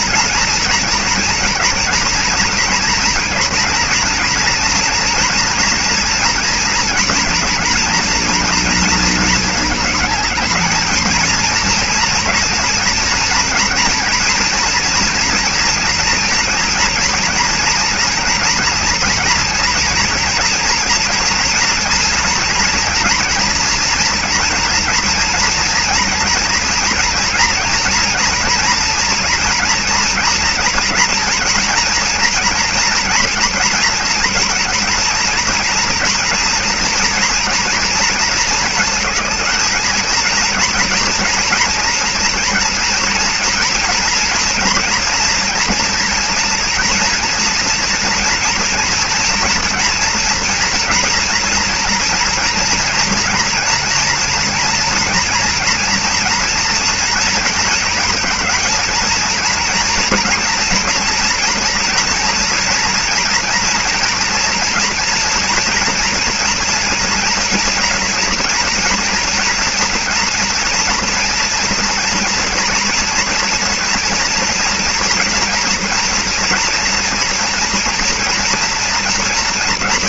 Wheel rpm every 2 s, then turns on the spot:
230, 230, 230, 230, 230, 210, 230, 230, 230, 240, 230, 230, 230, 240, 240, 230, 240, 240, 240, 230, 230, 240, 240, 230, 230, 230, 230, 230, 230, 220, 240, 240, 230, 230, 240, 230, 230, 230, 230, 230.
none